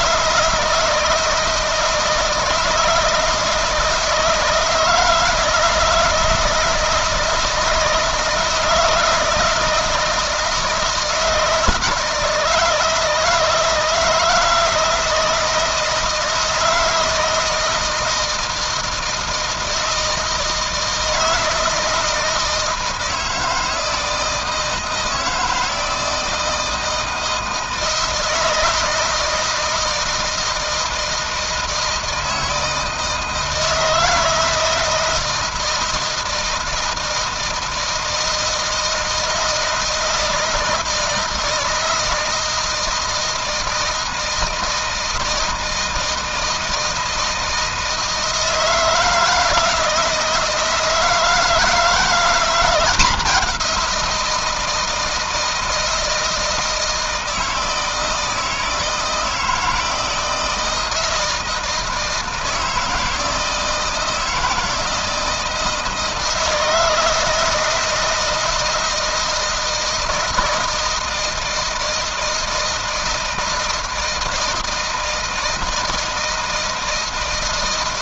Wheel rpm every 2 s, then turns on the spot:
160, 160, 160, 170, 160, 160, 160, 160, 160, 160, 160, 160, 160, 160, 160, 160, 160, 160, 160, 160, 160, 160, 160, 160, 160, 160, 180, 170, 160, 160, 160, 160, 160, 160, 160, 160, 160, 160, 160.
none